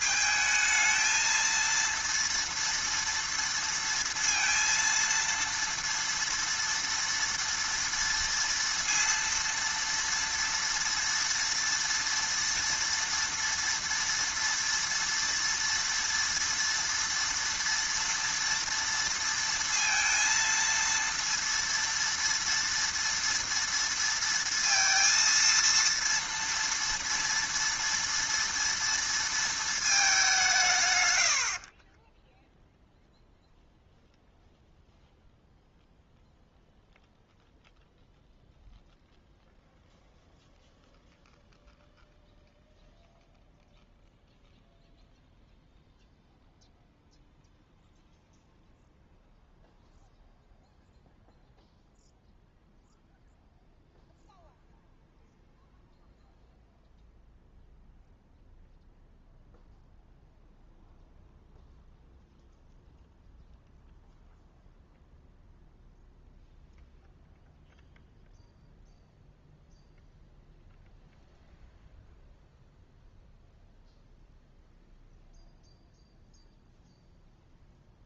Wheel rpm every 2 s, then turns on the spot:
220, 230, 230, 230, 230, 230, 230, 230, 230, 230, 230, 230, 230, 230, 230, 170, 0, 0, 0, 0, 0, 0, 0, 0, 0, 0, 0, 0, 0, 0, 0, 0, 0, 0, 0, 0, 0, 0, 0.
none